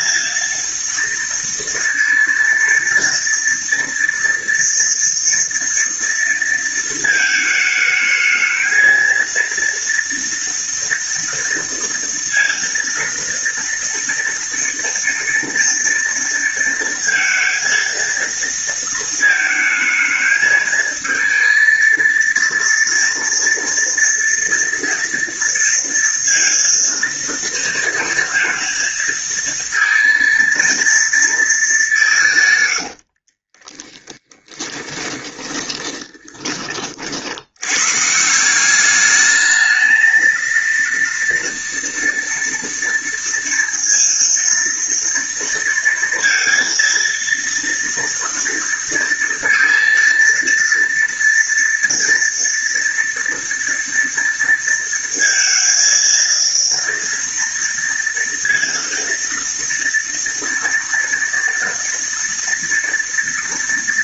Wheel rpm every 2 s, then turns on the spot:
230, 230, 230, 230, 220, 230, 230, 230, 230, 230, 220, 230, 230, 230, 230, 230, 150, 10, 20, 170, 230, 240, 230, 230, 230, 230, 230, 230, 230, 230, 230, 230.
none